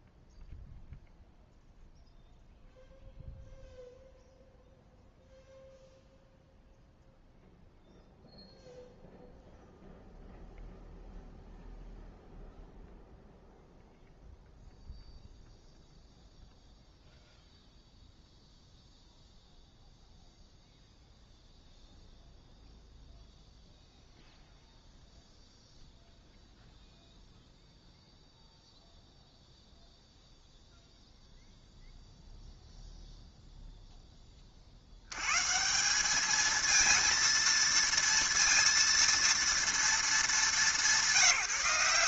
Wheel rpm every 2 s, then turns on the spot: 0, 0, 0, 0, 0, 0, 0, 0, 0, 0, 0, 0, 0, 0, 0, 0, 0, 40, 220, 230, 200.
none